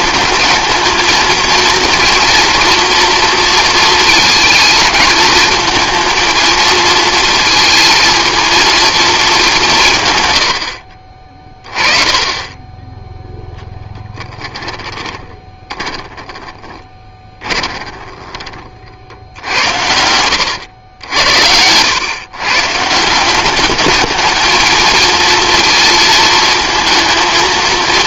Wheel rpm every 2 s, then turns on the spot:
220, 240, 220, 230, 230, 80, 20, 20, 20, 40, 90, 150, 220, 220.
14-18